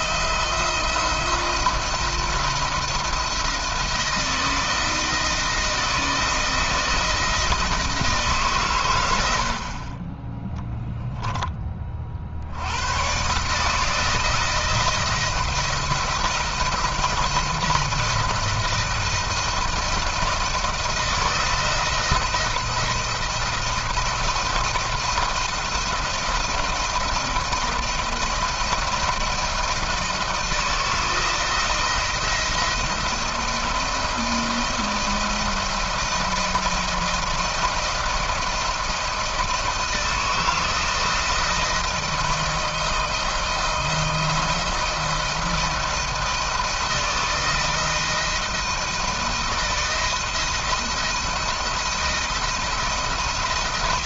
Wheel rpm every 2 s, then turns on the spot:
170, 170, 160, 160, 140, 10, 70, 160, 170, 170, 160, 170, 170, 160, 160, 160, 170, 160, 160, 160, 160, 170, 170, 160, 160, 160, 170.
none